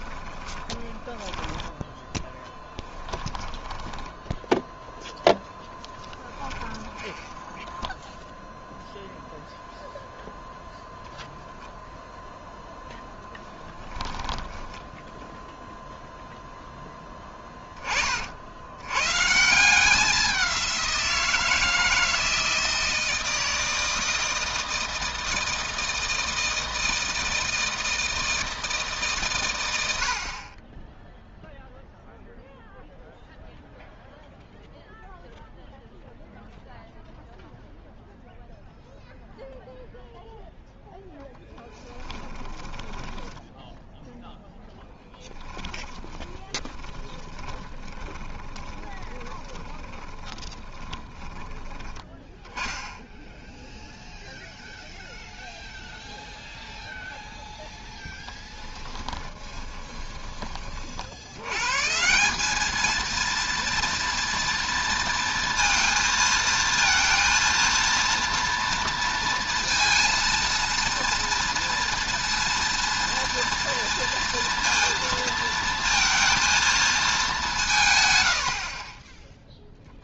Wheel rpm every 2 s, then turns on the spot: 20, 10, 0, 10, 0, 0, 0, 10, 0, 80, 180, 160, 160, 160, 160, 20, 0, 0, 0, 0, 0, 10, 0, 10, 20, 20, 10, 0, 0, 10, 40, 210, 230, 220, 230, 230, 230, 230, 230, 60.
0-4 6-8 14-16 42-44 46-52 58-60